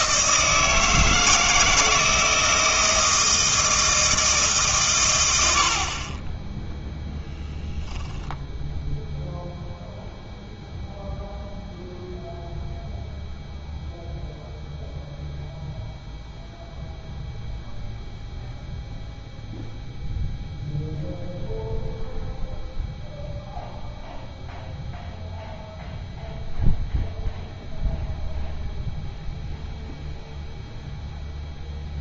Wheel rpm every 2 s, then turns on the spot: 160, 160, 130, 0, 0, 0, 0, 0, 0, 0, 0, 0, 0, 0, 0, 0.
none